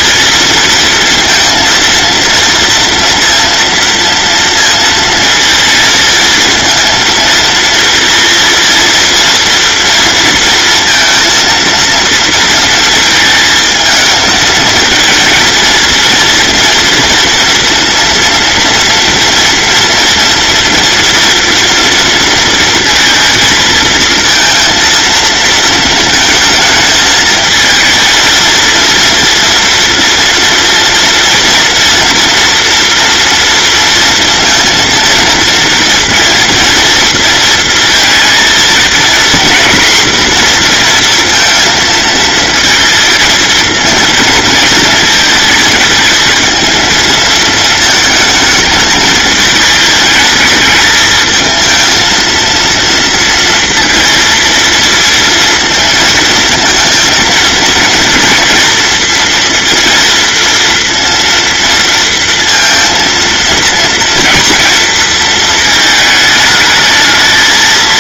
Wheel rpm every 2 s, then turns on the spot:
230, 230, 230, 230, 230, 230, 220, 230, 230, 230, 230, 230, 230, 220, 230, 230, 230, 230, 230, 230, 240, 220, 220, 230, 220, 220, 230, 230, 230, 230, 230, 230, 230, 220.
none